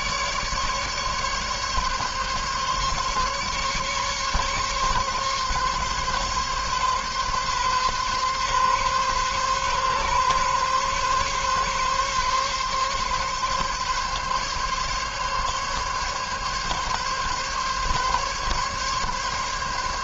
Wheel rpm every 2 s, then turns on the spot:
150, 140, 140, 140, 130, 140, 140, 140, 140, 140.
none